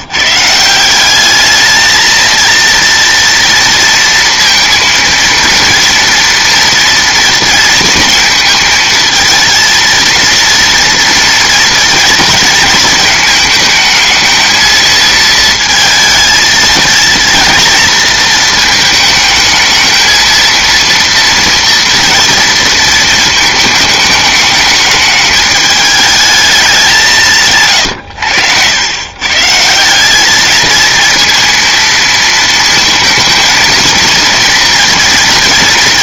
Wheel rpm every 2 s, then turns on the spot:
180, 230, 230, 230, 220, 230, 220, 230, 230, 220, 230, 230, 210, 200, 100, 220, 230, 230.
none